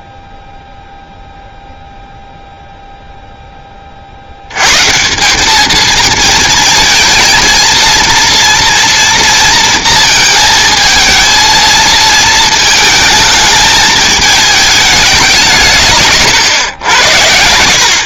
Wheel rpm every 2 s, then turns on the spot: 0, 0, 150, 230, 230, 220, 220, 200, 100.
none